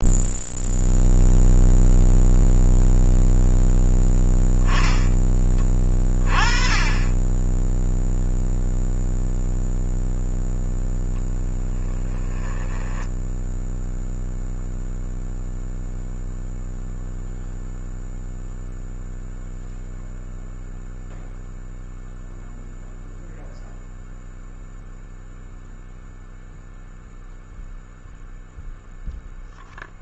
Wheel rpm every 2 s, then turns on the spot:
0, 0, 10, 20, 0, 10, 10, 0, 0, 0, 0, 0, 0, 0, 0.
12-14